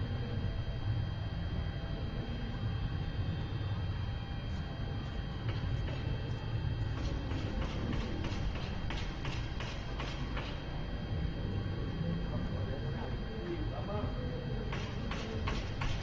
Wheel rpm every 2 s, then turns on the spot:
0, 0, 0, 0, 0, 0, 0, 0.
none